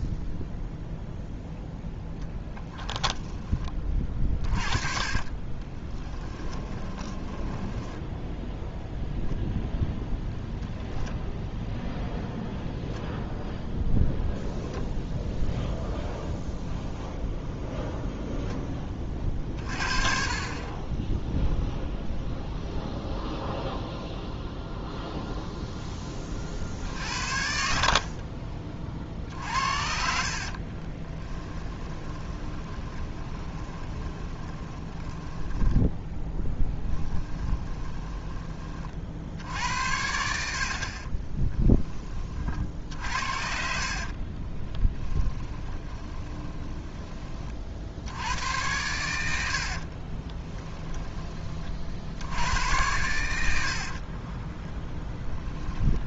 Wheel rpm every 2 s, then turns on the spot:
0, 10, 30, 20, 0, 0, 0, 0, 0, 10, 30, 0, 0, 50, 50, 40, 20, 10, 10, 20, 60, 50, 20, 10, 100, 10, 90, 20.
2-8 30-38 42-46 50-52 54-56